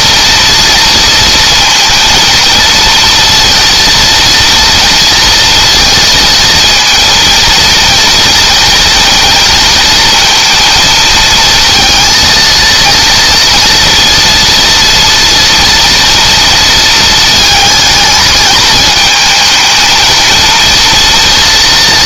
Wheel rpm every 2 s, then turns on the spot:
230, 230, 230, 220, 230, 220, 230, 230, 230, 220, 230.
none